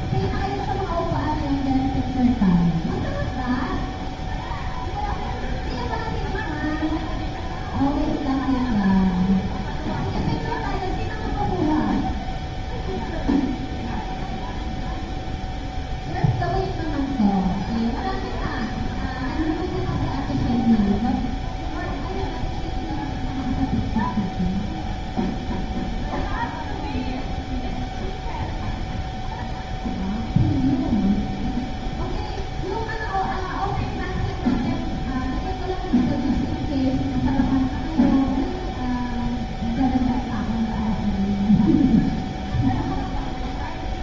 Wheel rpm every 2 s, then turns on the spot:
0, 0, 0, 0, 0, 0, 0, 0, 0, 0, 0, 0, 0, 0, 0, 0, 0, 0, 0, 0, 0, 0.
none